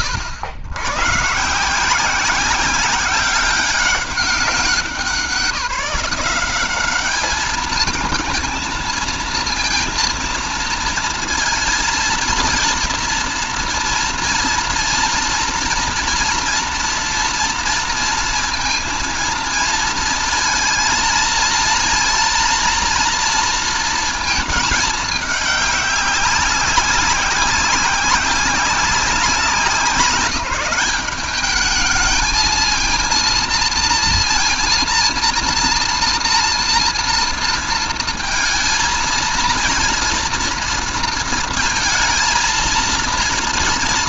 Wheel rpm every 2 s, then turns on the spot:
110, 190, 180, 190, 230, 230, 230, 230, 230, 230, 230, 230, 220, 190, 190, 190, 220, 230, 230, 230, 230, 230.
none